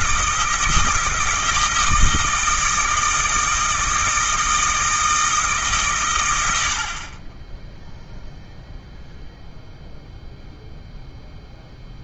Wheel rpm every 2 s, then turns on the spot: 160, 160, 160, 60, 0, 0.
none